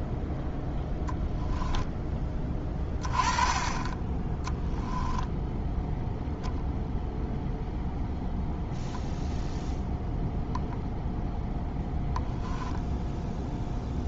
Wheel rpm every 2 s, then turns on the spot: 0, 20, 10, 0, 0, 0, 0.
none